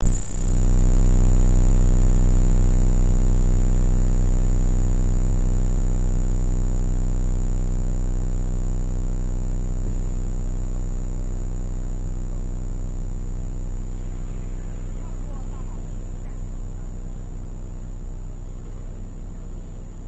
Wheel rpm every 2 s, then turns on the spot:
0, 0, 0, 0, 0, 0, 0, 0, 0, 0.
none